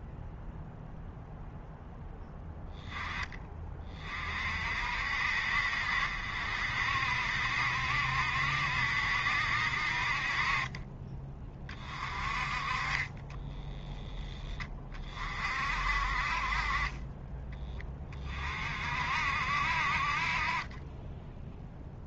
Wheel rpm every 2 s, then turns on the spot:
0, 10, 60, 60, 70, 30, 30, 30, 30, 50, 10.
12-14